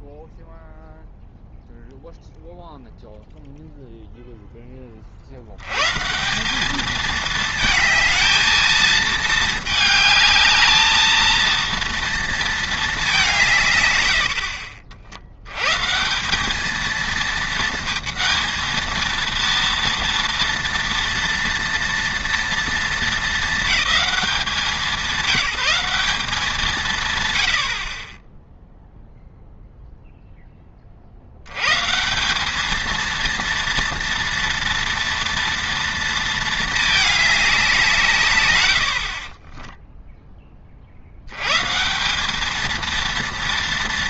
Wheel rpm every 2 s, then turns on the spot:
0, 0, 10, 200, 220, 220, 230, 50, 210, 230, 230, 230, 180, 160, 0, 10, 220, 230, 220, 90, 30, 220.
14-16